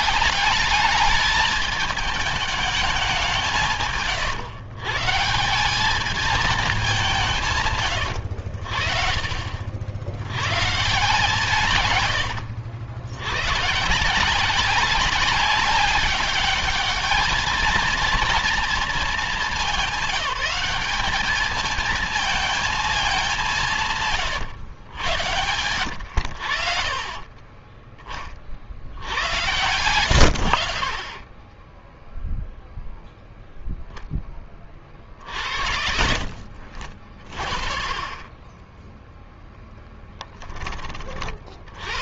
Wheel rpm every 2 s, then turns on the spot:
200, 210, 140, 210, 80, 130, 90, 170, 210, 230, 210, 220, 120, 70, 50, 70, 0, 30, 50, 10, 20.
none